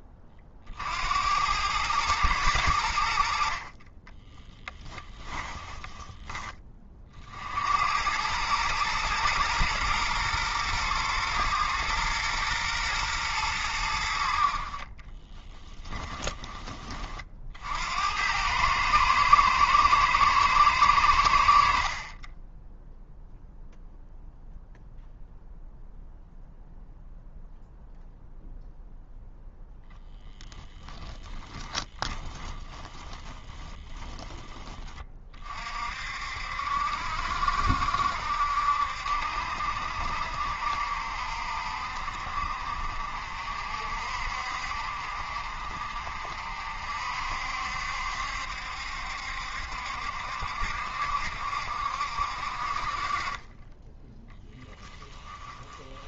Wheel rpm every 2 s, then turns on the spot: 60, 80, 20, 30, 110, 110, 110, 40, 30, 110, 100, 0, 0, 0, 0, 10, 20, 30, 70, 70, 60, 50, 60, 60, 70, 70, 50, 10.
4-6 14-16 30-34